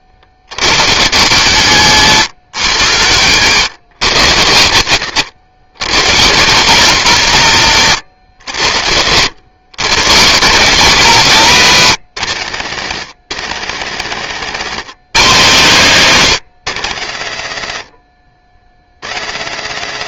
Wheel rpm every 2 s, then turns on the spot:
70, 100, 120, 160, 100, 140, 150, 200, 200, 90.
none